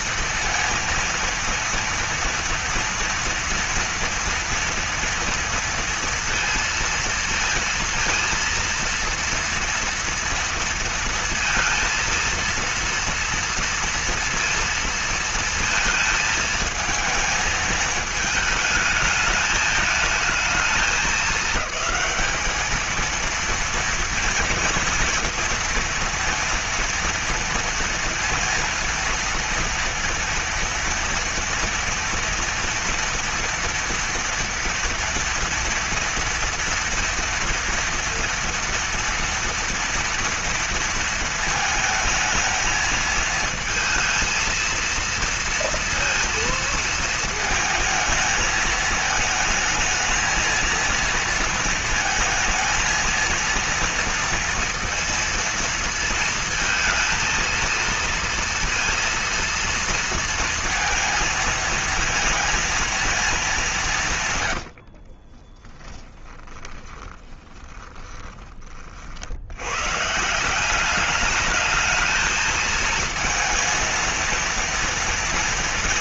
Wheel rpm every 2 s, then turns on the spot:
230, 230, 230, 230, 230, 230, 230, 230, 220, 220, 220, 220, 240, 230, 230, 230, 230, 230, 230, 240, 230, 220, 230, 230, 220, 220, 220, 230, 220, 230, 230, 230, 110, 20, 40, 180, 230, 230.
64-68